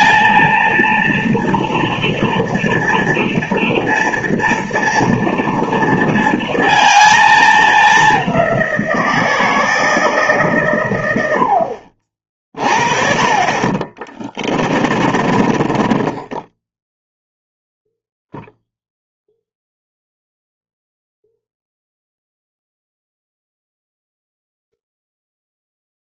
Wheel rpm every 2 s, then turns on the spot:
230, 240, 230, 220, 170, 120, 30, 30, 10, 0, 0, 0, 0.
14-18